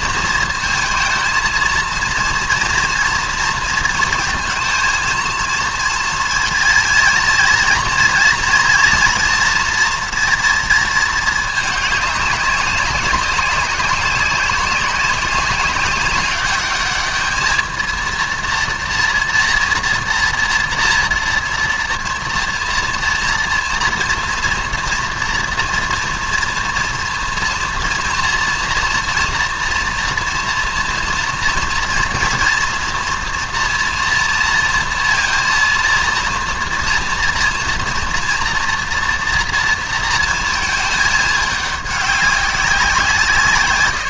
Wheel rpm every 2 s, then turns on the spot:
230, 220, 230, 230, 230, 230, 200, 200, 200, 230, 230, 230, 230, 230, 230, 230, 230, 230, 230, 230, 230, 200.
none